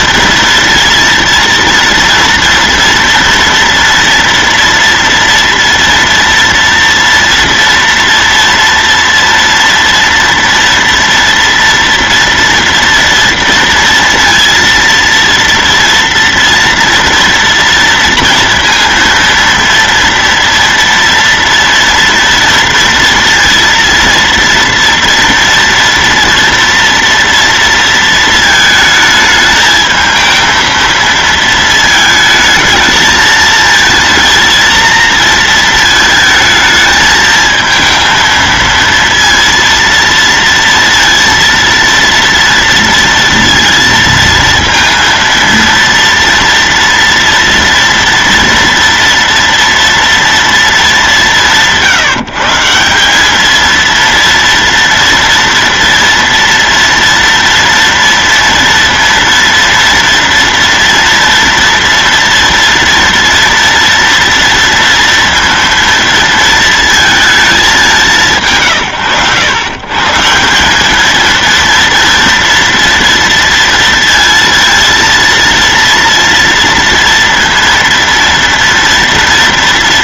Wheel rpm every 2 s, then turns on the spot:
240, 230, 230, 230, 230, 230, 230, 230, 230, 230, 230, 230, 230, 230, 220, 230, 220, 230, 220, 230, 230, 230, 230, 230, 230, 190, 200, 230, 230, 230, 230, 230, 230, 220, 120, 220, 230, 230, 230, 230.
none